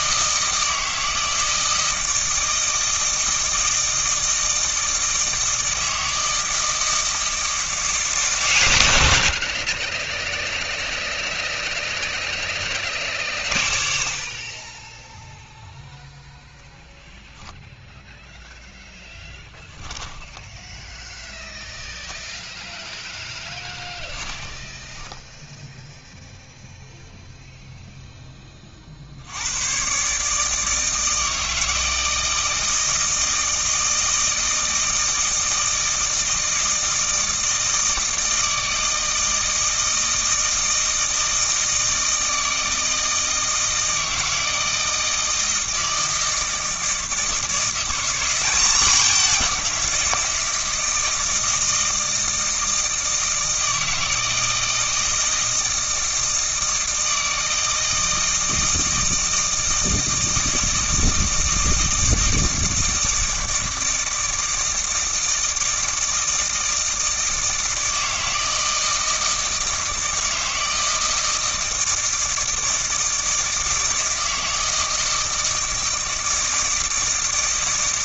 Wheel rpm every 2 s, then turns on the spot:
160, 160, 160, 160, 110, 0, 20, 20, 0, 0, 10, 10, 10, 0, 20, 160, 160, 160, 160, 160, 160, 160, 160, 160, 190, 160, 160, 160, 160, 160, 160, 160, 160, 160, 160, 160, 160, 160, 160.
24-26